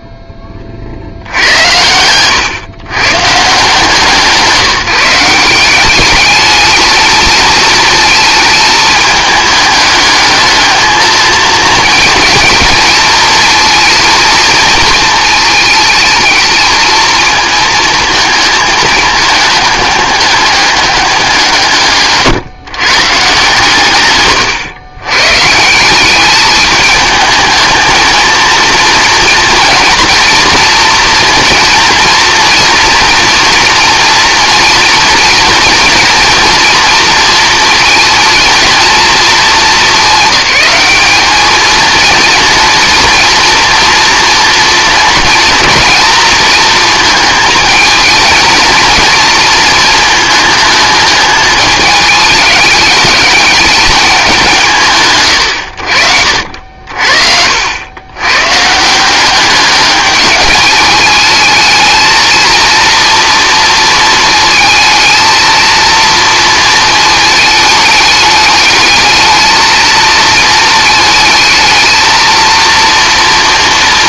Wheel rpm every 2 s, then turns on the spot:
30, 120, 170, 220, 220, 220, 220, 230, 220, 220, 210, 150, 120, 210, 230, 230, 240, 240, 240, 230, 210, 230, 230, 230, 230, 220, 210, 160, 60, 150, 210, 230, 220, 230, 210, 220, 230.
none